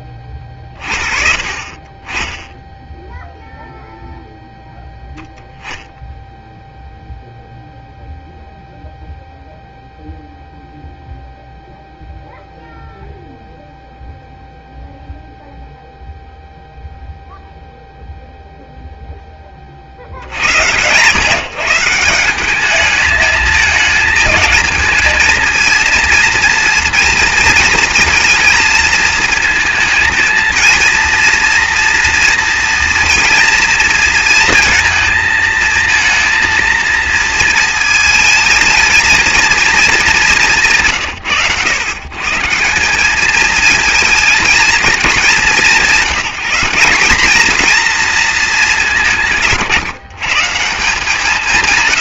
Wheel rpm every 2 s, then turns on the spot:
20, 0, 0, 0, 0, 0, 0, 0, 0, 0, 110, 210, 220, 230, 230, 230, 240, 230, 230, 230, 160, 180, 220, 190, 200, 160.
none